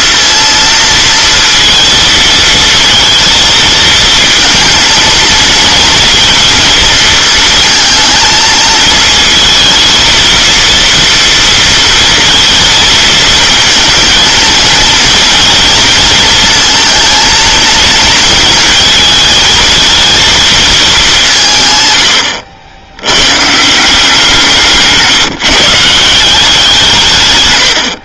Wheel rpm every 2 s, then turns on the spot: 230, 230, 230, 230, 230, 230, 230, 230, 230, 230, 220, 90, 160, 170.
none